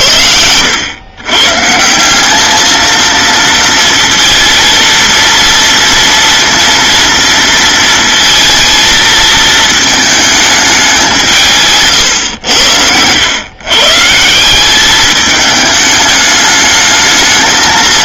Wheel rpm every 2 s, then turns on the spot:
100, 220, 230, 230, 220, 200, 90, 190, 210.
none